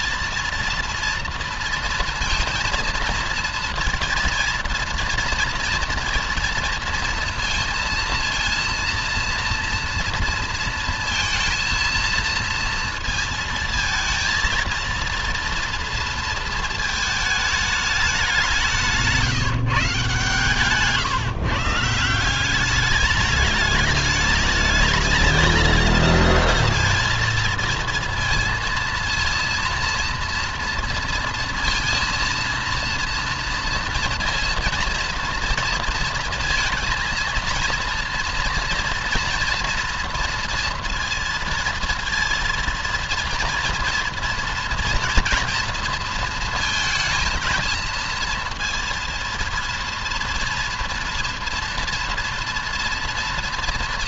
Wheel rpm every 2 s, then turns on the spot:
230, 230, 230, 230, 230, 230, 230, 230, 230, 170, 130, 200, 230, 230, 230, 230, 230, 230, 230, 230, 230, 230, 240, 230, 230, 230, 230.
18-20